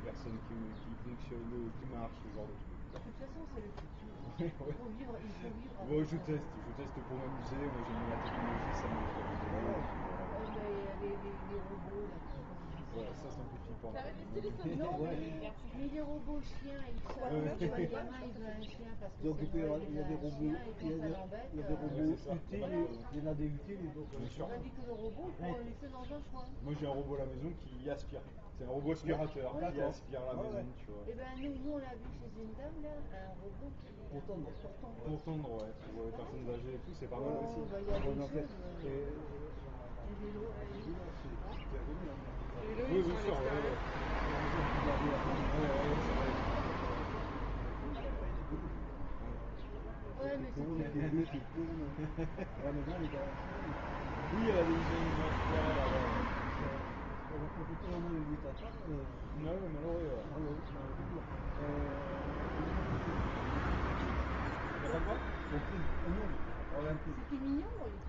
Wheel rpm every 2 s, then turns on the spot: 0, 0, 0, 0, 0, 0, 0, 0, 0, 0, 0, 0, 0, 0, 0, 0, 0, 0, 0, 0, 0, 0, 0, 0, 0, 0, 0, 0, 0, 0, 0, 0, 0, 0.
none